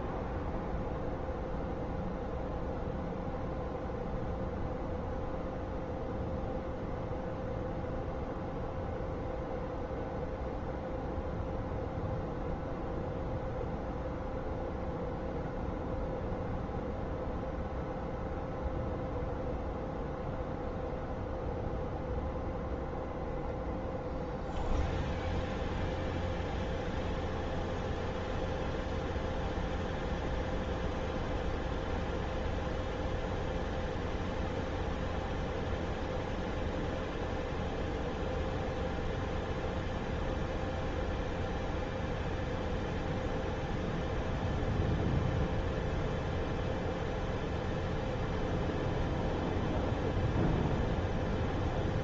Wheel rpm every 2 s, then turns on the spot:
0, 0, 0, 0, 0, 0, 0, 0, 0, 0, 0, 0, 0, 0, 0, 0, 0, 0, 0, 0, 0, 0, 0, 0, 0, 0.
none